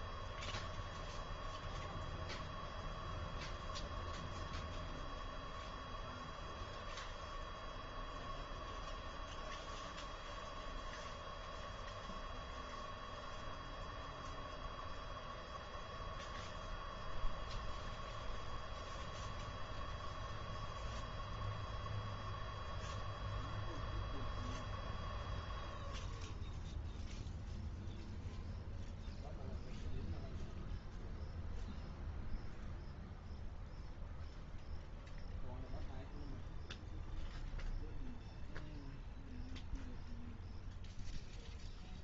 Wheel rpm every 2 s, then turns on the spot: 0, 0, 0, 0, 0, 0, 0, 0, 0, 0, 0, 0, 0, 0, 0, 0, 0, 0, 0, 0, 0.
none